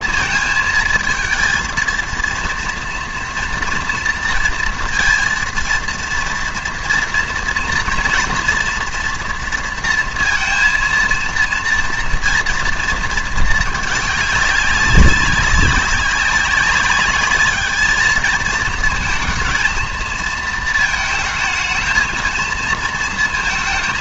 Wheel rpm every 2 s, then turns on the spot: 220, 230, 230, 240, 230, 230, 230, 190, 200, 220, 230, 230.
none